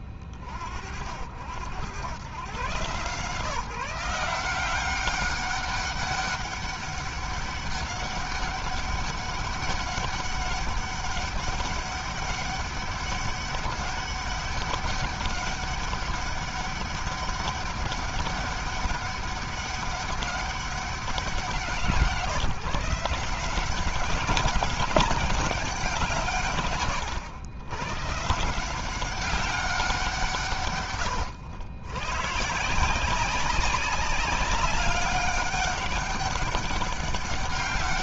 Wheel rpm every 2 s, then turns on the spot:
50, 100, 170, 200, 200, 200, 200, 200, 200, 200, 200, 160, 190, 160, 150, 150, 130, 200, 200.
none